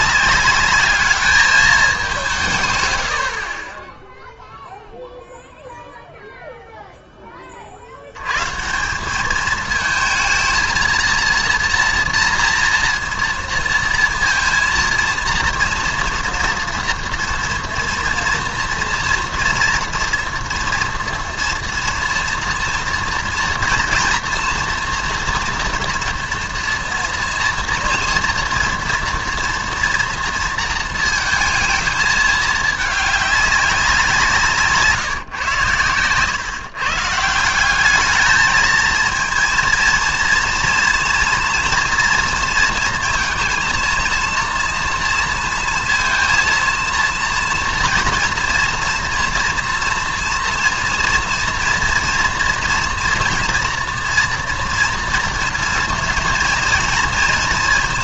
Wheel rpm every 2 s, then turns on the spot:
200, 140, 0, 0, 160, 230, 230, 230, 230, 230, 230, 230, 230, 230, 230, 230, 210, 150, 130, 220, 230, 230, 230, 230, 230, 230, 230, 230, 230.
none